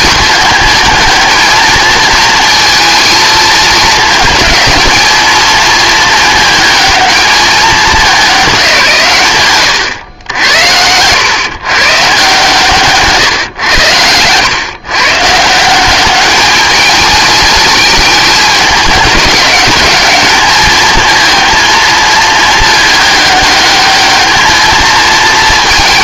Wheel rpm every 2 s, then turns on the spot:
220, 230, 220, 220, 180, 90, 150, 120, 210, 210, 220, 210, 220.
none